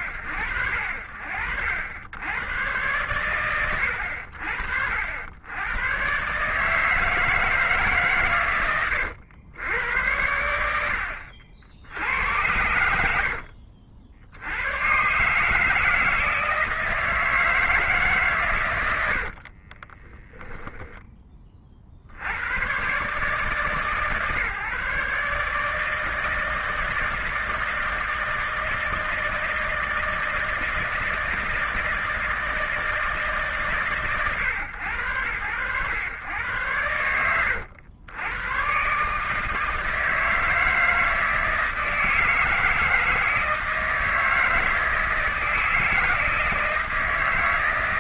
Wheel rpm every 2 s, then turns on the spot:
70, 80, 120, 130, 90, 80, 60, 160, 150, 40, 50, 150, 150, 160, 160, 160, 140, 100, 90, 160, 160, 160, 160, 160.
18-20